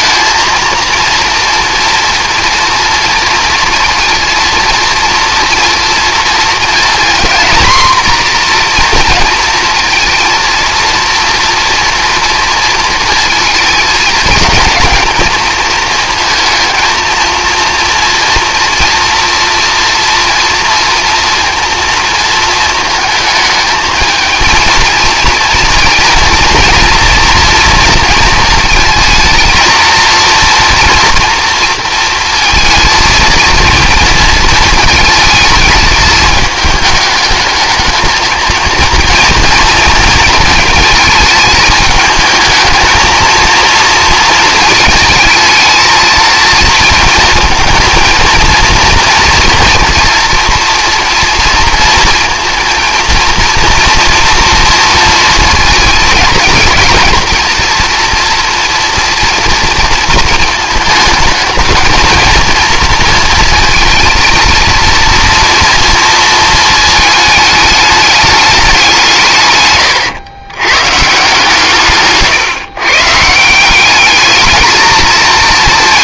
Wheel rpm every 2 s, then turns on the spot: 230, 230, 230, 230, 240, 230, 230, 230, 230, 230, 230, 220, 230, 230, 230, 230, 230, 220, 210, 230, 220, 220, 230, 230, 230, 240, 230, 230, 220, 230, 220, 230, 230, 220, 200, 120, 140, 220.
none